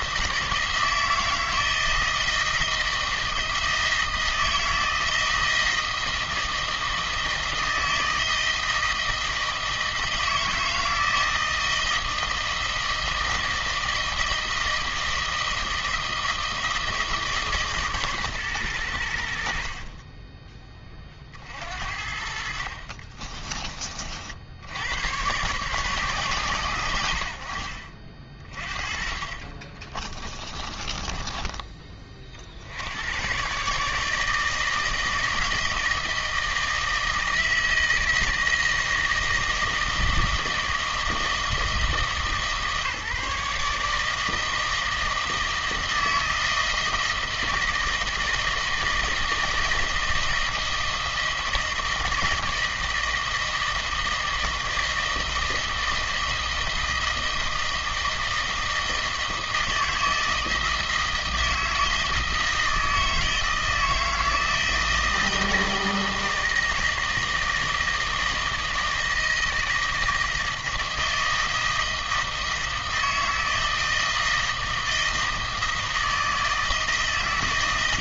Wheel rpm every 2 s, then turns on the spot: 160, 160, 160, 160, 160, 160, 160, 160, 160, 110, 20, 50, 80, 100, 40, 20, 80, 160, 160, 160, 160, 150, 160, 160, 160, 160, 160, 160, 160, 160, 160, 160, 160, 160, 160, 160, 160, 160, 160.
22-24 30-32